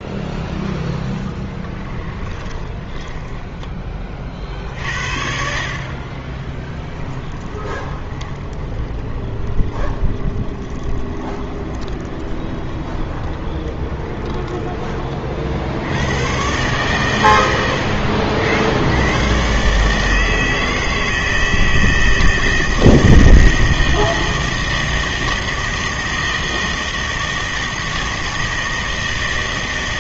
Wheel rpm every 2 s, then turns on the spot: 10, 20, 60, 10, 20, 20, 20, 20, 120, 100, 160, 160, 160, 160, 160.
2-4 6-14